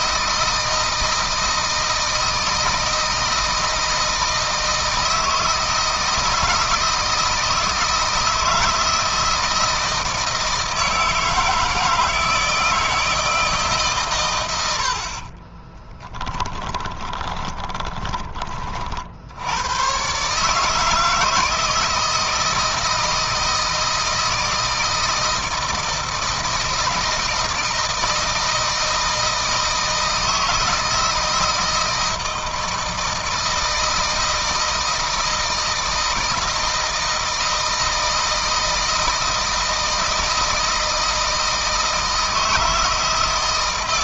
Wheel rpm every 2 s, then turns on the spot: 160, 160, 160, 160, 160, 160, 160, 70, 20, 50, 160, 160, 160, 160, 160, 160, 160, 160, 160, 160, 160, 160.
16-18